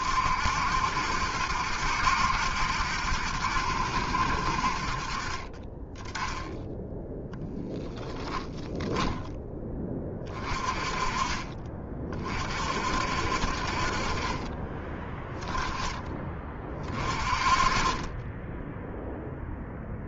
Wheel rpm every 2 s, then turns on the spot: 70, 70, 60, 10, 0, 20, 40, 30, 20, 20.
none